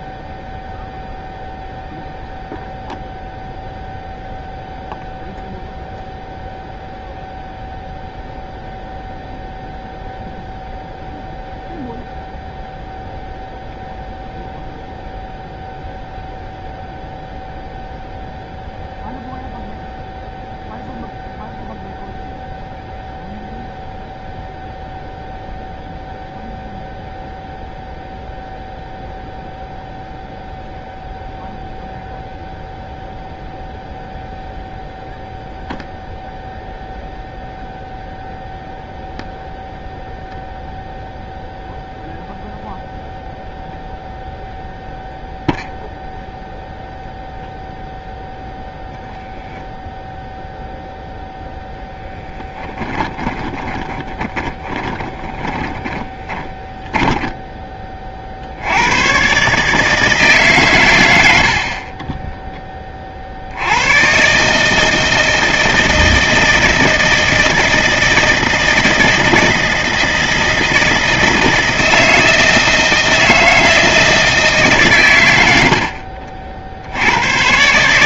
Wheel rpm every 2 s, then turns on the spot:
0, 0, 0, 0, 0, 0, 0, 0, 0, 0, 0, 0, 0, 0, 0, 0, 0, 0, 0, 0, 0, 0, 0, 0, 0, 0, 20, 20, 10, 100, 100, 30, 150, 160, 160, 160, 160, 140, 70.
52-58